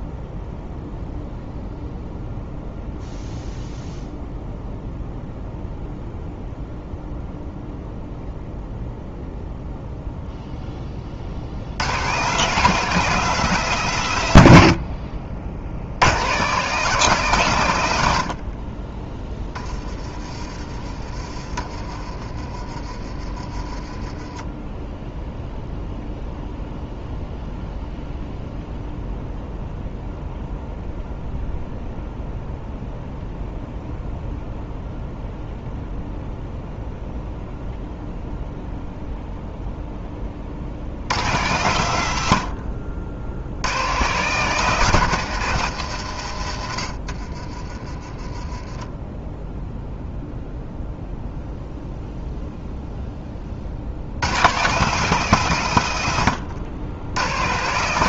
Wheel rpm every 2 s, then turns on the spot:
0, 0, 0, 0, 0, 0, 170, 90, 160, 40, 30, 30, 10, 0, 0, 0, 0, 0, 0, 0, 60, 70, 160, 70, 20, 0, 0, 150, 80.
none